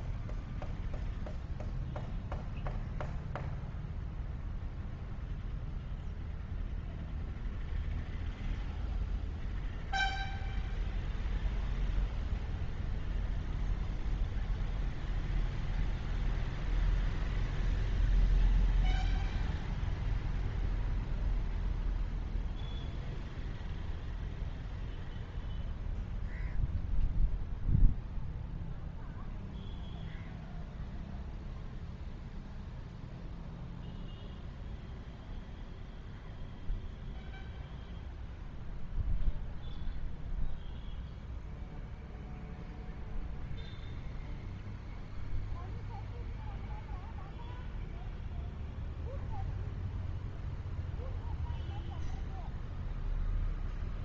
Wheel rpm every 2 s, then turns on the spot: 0, 0, 0, 0, 0, 0, 0, 0, 0, 0, 0, 0, 0, 0, 0, 0, 0, 0, 0, 0, 0, 0, 0, 0, 0, 0, 0.
none